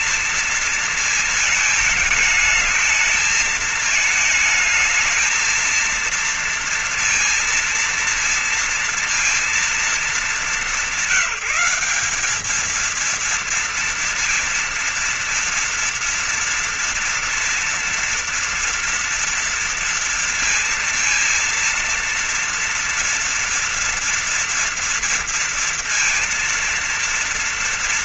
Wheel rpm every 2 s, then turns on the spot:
230, 220, 220, 230, 230, 210, 200, 230, 230, 230, 230, 230, 240, 230.
none